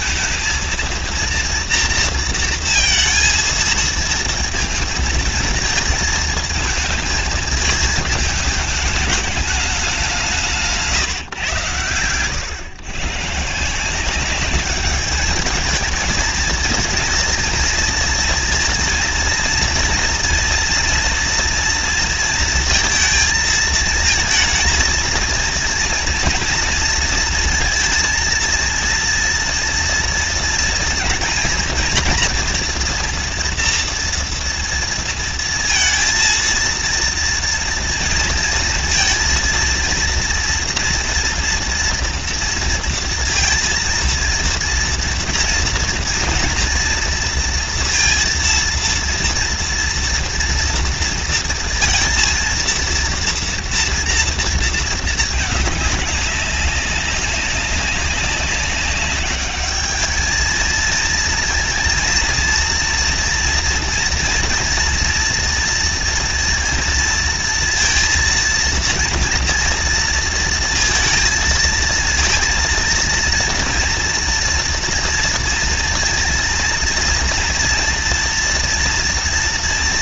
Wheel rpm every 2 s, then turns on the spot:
230, 230, 220, 220, 220, 170, 110, 200, 220, 230, 230, 230, 220, 230, 230, 230, 230, 230, 230, 230, 230, 230, 230, 240, 230, 230, 230, 230, 200, 190, 220, 230, 230, 230, 230, 230, 230, 230, 230, 230.
none